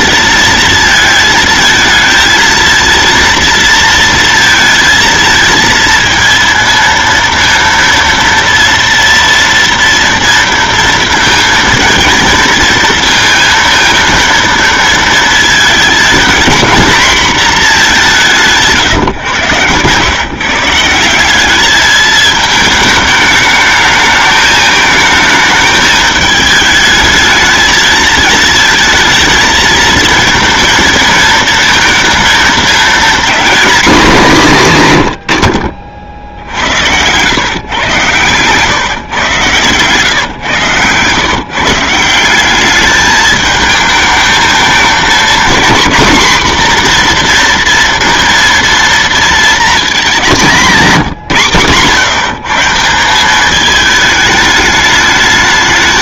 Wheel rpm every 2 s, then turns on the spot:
230, 230, 230, 230, 230, 230, 230, 230, 230, 170, 150, 210, 220, 220, 220, 220, 220, 180, 70, 130, 120, 200, 220, 240, 230, 190, 160, 210.
none